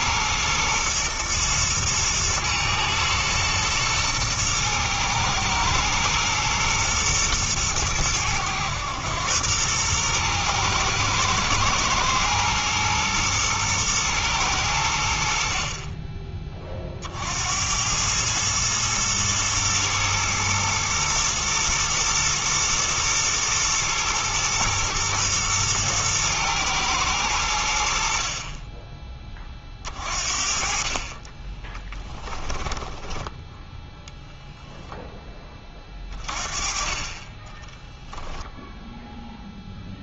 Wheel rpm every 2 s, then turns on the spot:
120, 110, 110, 110, 100, 120, 120, 100, 30, 110, 120, 110, 120, 110, 20, 50, 10, 0, 30, 0.
32-34